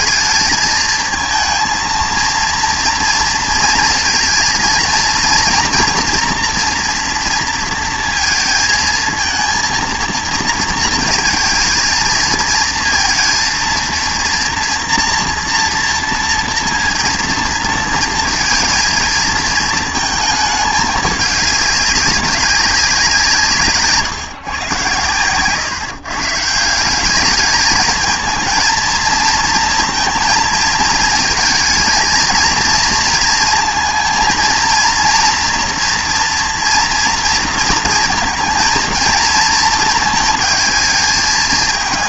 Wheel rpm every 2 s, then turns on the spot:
220, 230, 230, 240, 220, 230, 230, 240, 230, 230, 210, 200, 120, 160, 220, 220, 230, 230, 230, 230, 220.
none